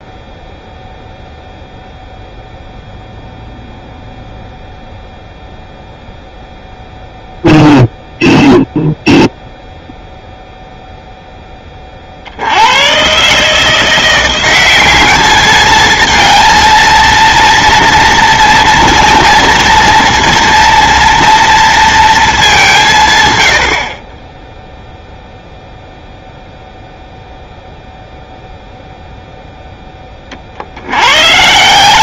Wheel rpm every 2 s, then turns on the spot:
0, 0, 0, 0, 0, 0, 90, 190, 230, 230, 230, 190, 0, 0, 0, 60.
none